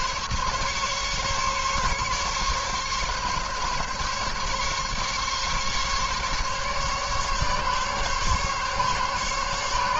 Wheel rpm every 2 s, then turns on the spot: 140, 140, 140, 140, 140.
none